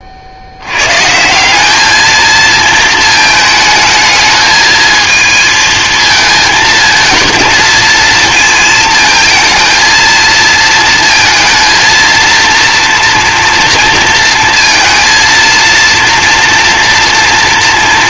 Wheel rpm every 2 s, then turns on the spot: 100, 230, 220, 220, 230, 230, 240, 230, 230.
none